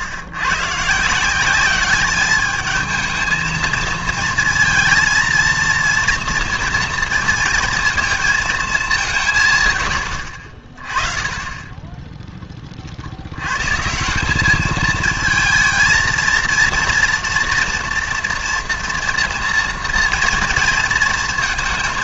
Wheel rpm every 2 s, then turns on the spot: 130, 210, 230, 230, 220, 50, 20, 210, 230, 230, 230.
none